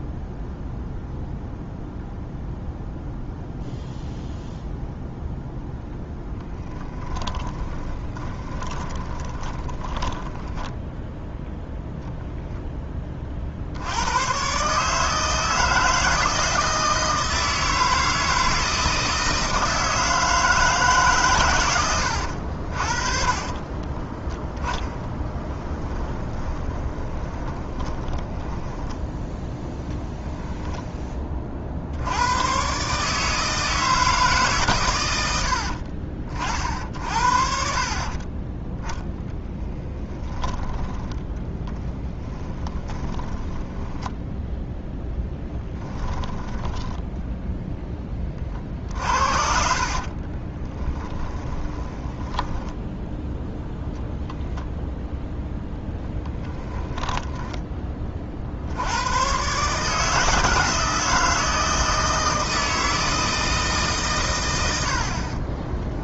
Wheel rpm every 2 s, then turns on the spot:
0, 0, 0, 20, 20, 10, 10, 150, 160, 160, 150, 60, 20, 20, 10, 10, 140, 120, 50, 10, 10, 20, 0, 10, 50, 20, 10, 0, 10, 70, 160, 160, 70.
6-10 22-28 40-44 46-52 56-58